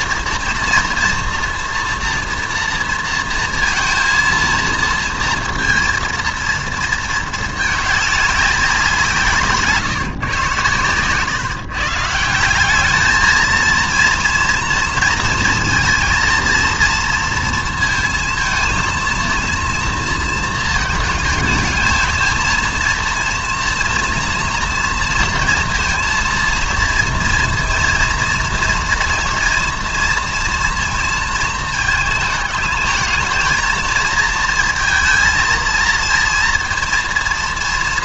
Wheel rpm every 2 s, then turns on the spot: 230, 230, 230, 230, 180, 120, 200, 230, 230, 230, 220, 230, 230, 230, 240, 230, 210, 230, 230.
none